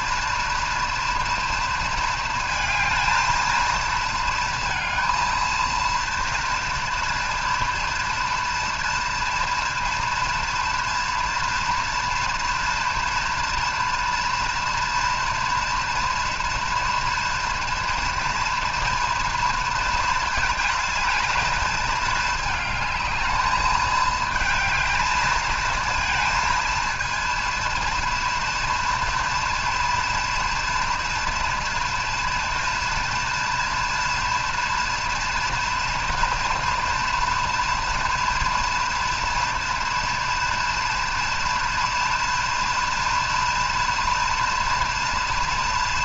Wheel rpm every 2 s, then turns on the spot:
230, 220, 230, 230, 230, 230, 240, 240, 230, 230, 220, 220, 220, 230, 230, 230, 230, 240, 240, 230, 230, 230, 230.
none